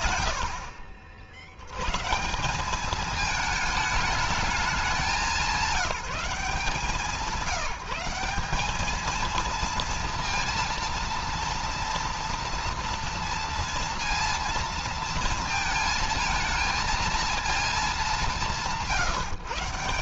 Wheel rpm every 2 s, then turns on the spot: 80, 210, 200, 180, 210, 230, 230, 230, 230, 150.
none